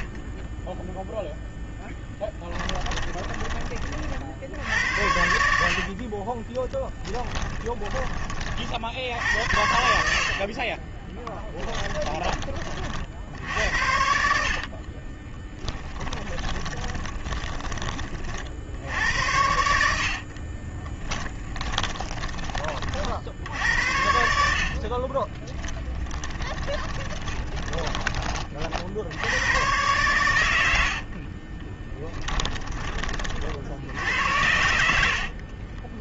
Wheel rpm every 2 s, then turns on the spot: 0, 20, 80, 20, 70, 20, 60, 20, 20, 80, 20, 60, 30, 20, 80, 60, 40, 70.
2-8 10-12 14-18 20-22 24-28 30-32 34-36